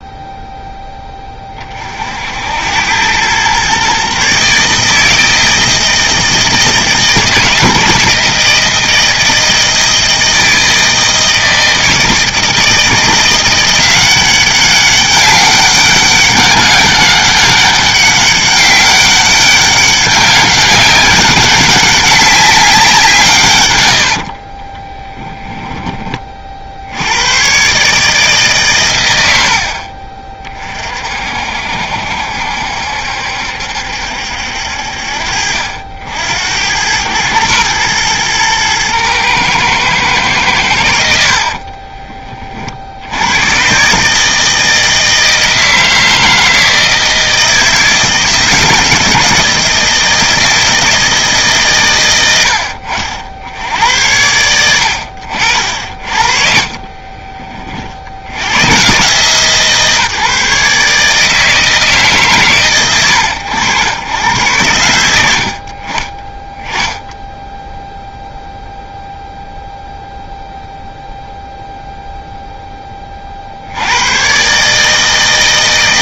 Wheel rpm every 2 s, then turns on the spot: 10, 90, 150, 160, 160, 160, 160, 200, 200, 200, 190, 180, 10, 60, 120, 40, 70, 60, 100, 110, 90, 60, 160, 160, 160, 160, 70, 90, 40, 120, 150, 100, 70, 10, 0, 0, 20, 150.
24-26 52-54